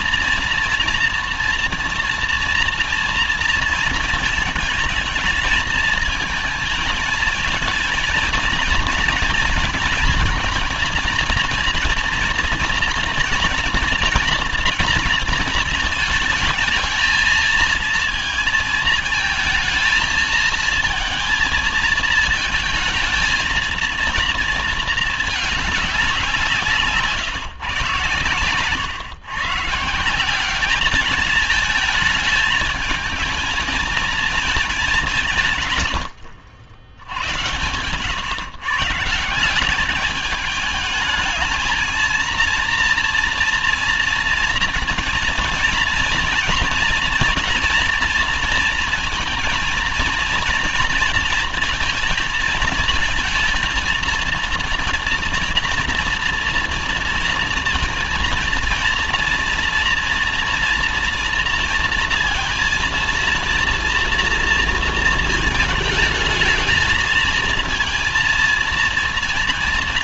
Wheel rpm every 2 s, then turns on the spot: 240, 240, 220, 220, 230, 230, 230, 230, 220, 230, 220, 220, 230, 170, 130, 190, 220, 220, 80, 130, 210, 230, 230, 230, 230, 240, 220, 230, 230, 230, 230, 230, 230, 220, 230.
none